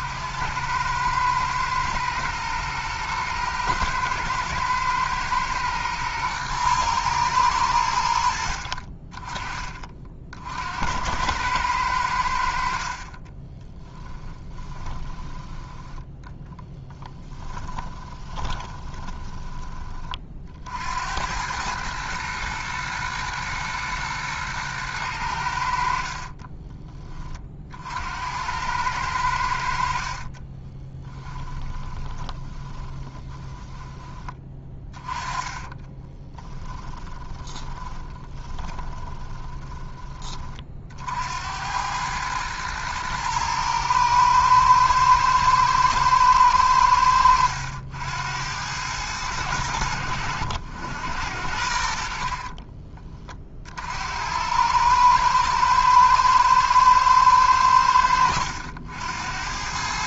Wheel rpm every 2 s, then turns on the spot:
110, 110, 120, 110, 40, 70, 50, 10, 10, 30, 70, 110, 110, 20, 90, 20, 20, 20, 10, 20, 50, 110, 110, 90, 90, 90, 30, 100, 110, 80.
14-20 30-40 52-54